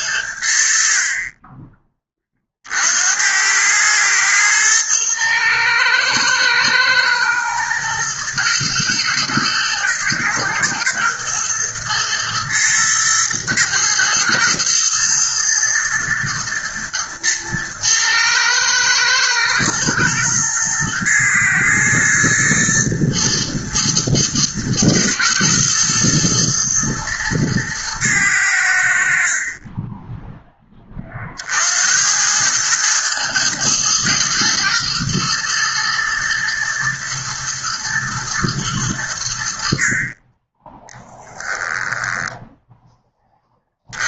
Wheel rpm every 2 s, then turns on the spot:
50, 70, 110, 110, 120, 120, 110, 120, 110, 110, 110, 120, 110, 110, 70, 30, 110, 120, 120, 90, 10, 10.
none